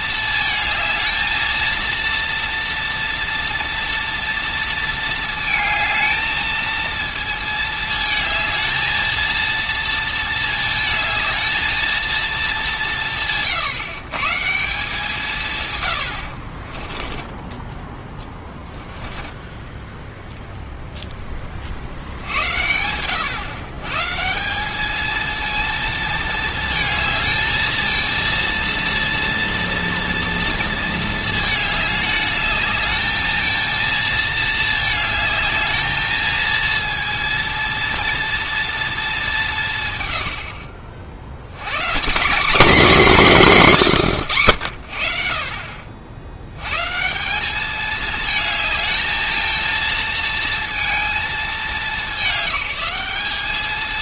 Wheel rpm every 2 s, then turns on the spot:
220, 230, 230, 230, 220, 220, 200, 180, 30, 10, 0, 90, 200, 220, 230, 230, 210, 220, 230, 230, 60, 220, 80, 120, 220, 220, 190.
16-20